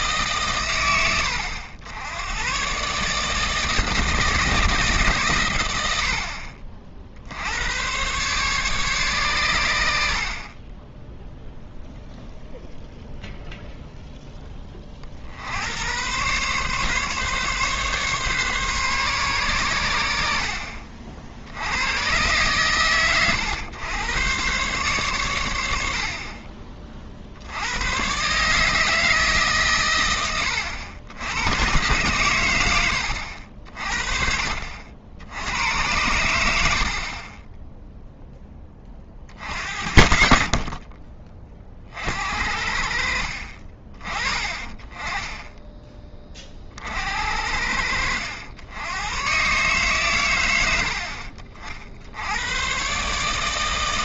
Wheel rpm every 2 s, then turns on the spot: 130, 120, 160, 50, 140, 40, 0, 20, 140, 140, 60, 120, 130, 30, 150, 110, 100, 60, 70, 20, 60, 60, 30, 40, 80, 90, 110.
40-42